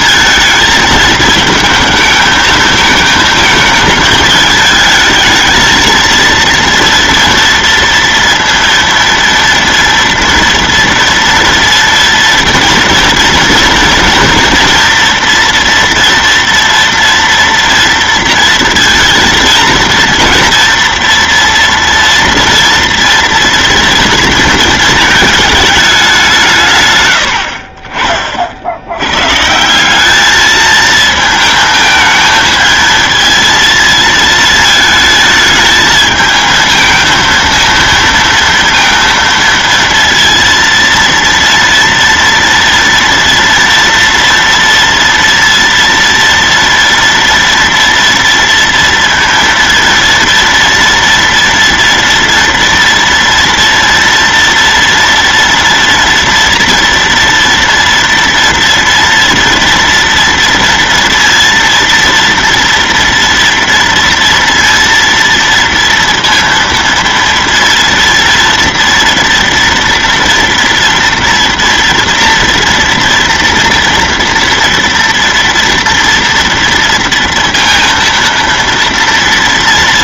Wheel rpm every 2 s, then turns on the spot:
220, 220, 220, 230, 230, 230, 230, 240, 230, 230, 230, 230, 230, 140, 70, 220, 220, 220, 220, 230, 230, 230, 230, 230, 230, 230, 230, 230, 230, 230, 230, 230, 230, 230, 230, 230, 230, 240, 230, 230.
none